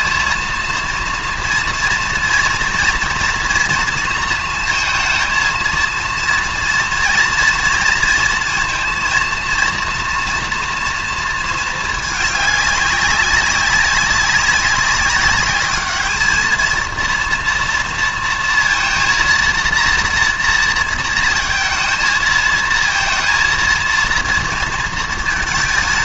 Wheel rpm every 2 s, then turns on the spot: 230, 230, 230, 230, 230, 240, 200, 200, 230, 230, 230, 230, 230.
none